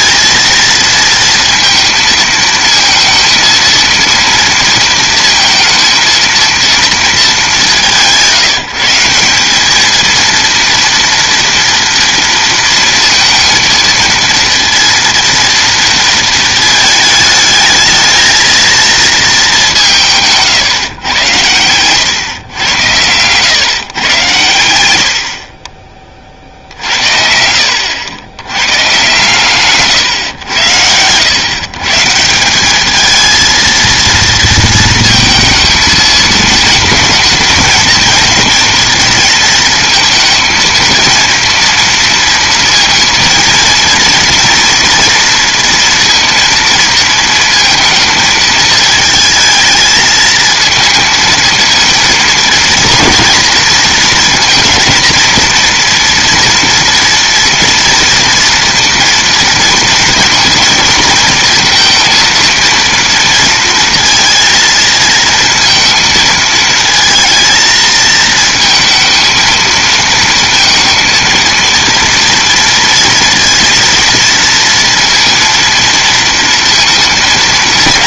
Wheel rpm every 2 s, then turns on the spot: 230, 230, 230, 230, 170, 230, 230, 230, 220, 220, 150, 100, 100, 60, 110, 100, 190, 230, 230, 230, 230, 230, 230, 230, 220, 230, 230, 230, 230, 230, 230, 230, 230, 220, 230, 230, 230, 230, 230.
none